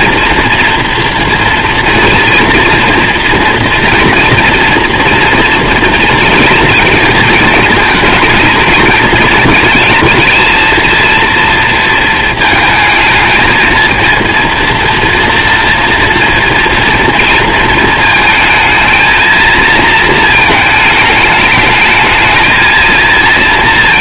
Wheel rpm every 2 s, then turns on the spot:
230, 230, 230, 230, 230, 230, 220, 230, 230, 220, 210, 230.
none